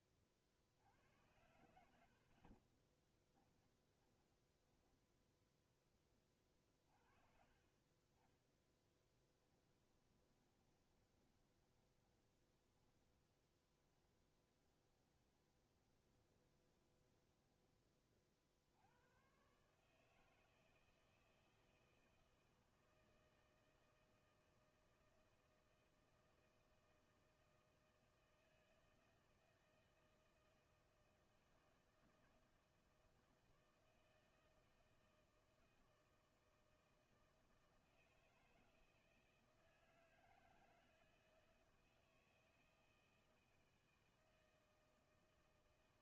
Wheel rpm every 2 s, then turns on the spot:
40, 50, 10, 30, 20, 20, 10, 20, 10, 40, 160, 160, 160, 160, 160, 160, 160, 160, 160, 160, 160, 160, 160.
4-6 8-18